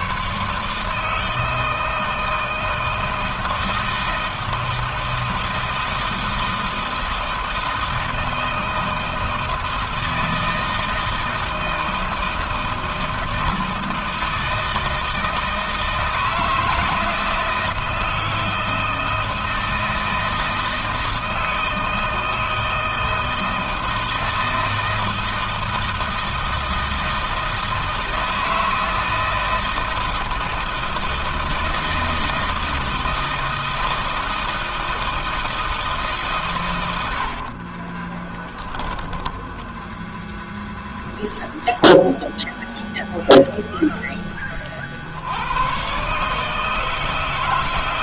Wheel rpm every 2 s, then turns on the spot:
150, 160, 160, 160, 160, 160, 160, 160, 160, 160, 160, 160, 160, 160, 160, 160, 160, 160, 100, 10, 0, 0, 60, 160.
38-40